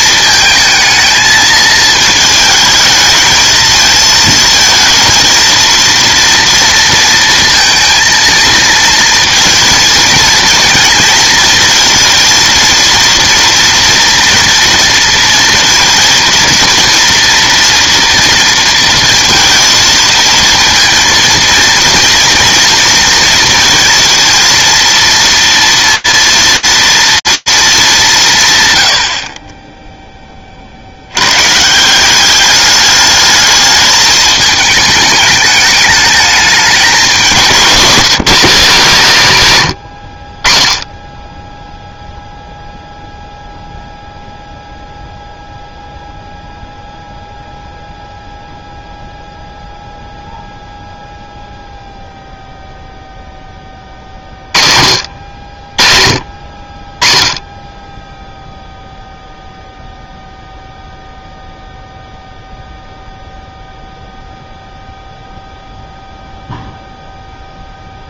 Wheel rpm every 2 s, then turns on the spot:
220, 220, 230, 230, 230, 220, 230, 230, 230, 230, 230, 230, 230, 230, 100, 50, 210, 210, 210, 200, 30, 0, 0, 0, 0, 0, 0, 50, 30, 0, 0, 0, 0, 0.
none